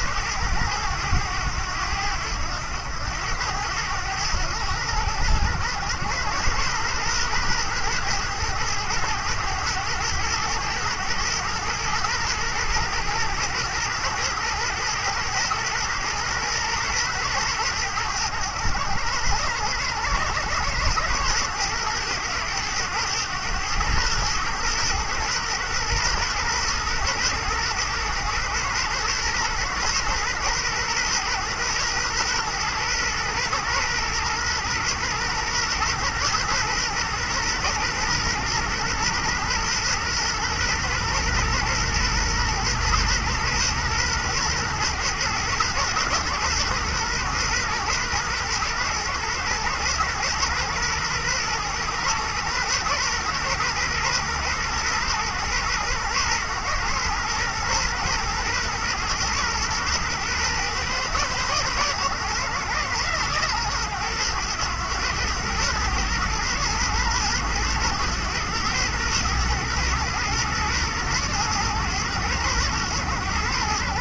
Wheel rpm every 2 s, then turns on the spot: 100, 90, 100, 110, 110, 110, 110, 110, 120, 100, 110, 110, 120, 120, 120, 120, 120, 120, 120, 120, 120, 120, 120, 120, 120, 120, 120, 120, 120, 120, 120, 120, 110, 110, 110, 110, 110.
none